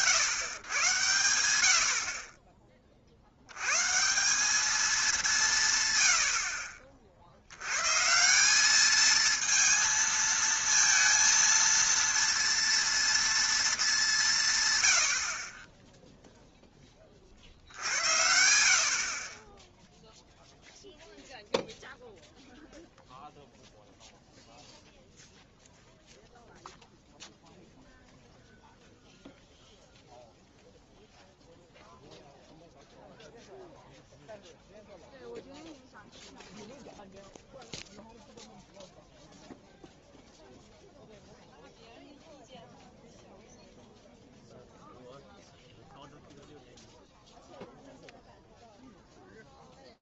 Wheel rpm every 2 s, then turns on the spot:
110, 20, 210, 40, 200, 230, 230, 110, 20, 60, 0, 0, 0, 0, 0, 0, 0, 0, 0, 0, 0, 0, 0, 0, 0.
none